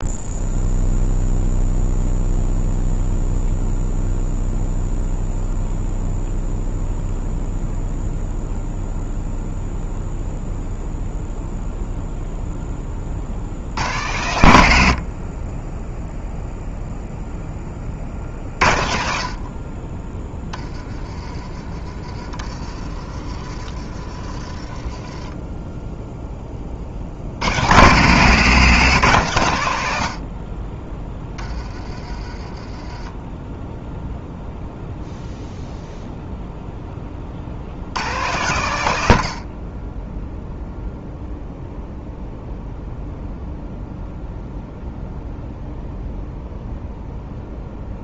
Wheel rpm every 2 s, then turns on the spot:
0, 0, 0, 0, 0, 0, 10, 80, 0, 50, 20, 40, 30, 30, 160, 30, 20, 0, 0, 120, 0, 0, 0, 0.
22-26